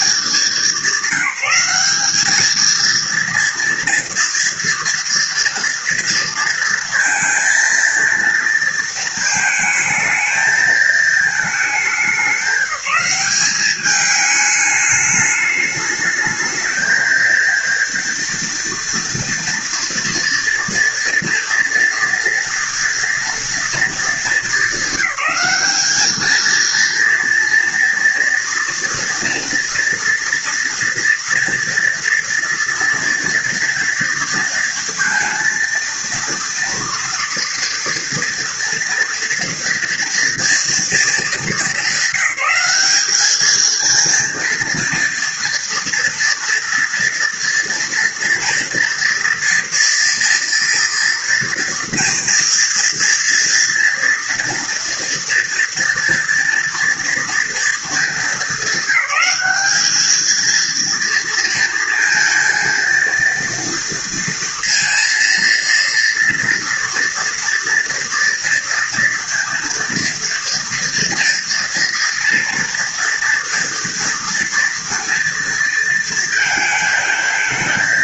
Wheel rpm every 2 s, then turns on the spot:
190, 230, 230, 230, 220, 220, 200, 210, 220, 230, 230, 230, 220, 230, 230, 230, 230, 230, 230, 230, 220, 210, 230, 230, 230, 230, 240, 230, 230, 210, 230, 230, 230, 240, 230, 230, 230, 230, 220.
none